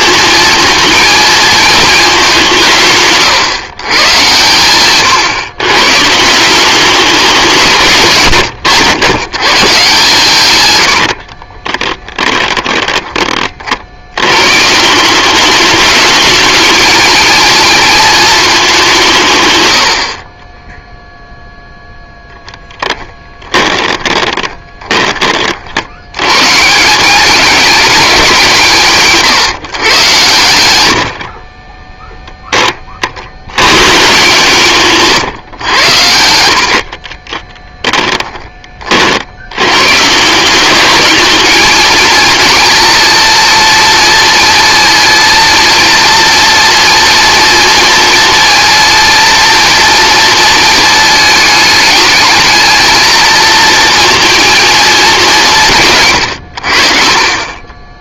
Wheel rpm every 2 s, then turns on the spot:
230, 160, 110, 200, 100, 110, 10, 160, 220, 210, 10, 10, 20, 160, 160, 100, 20, 150, 70, 40, 200, 240, 230, 230, 230, 220, 220, 230, 70.
10-14 22-26 36-38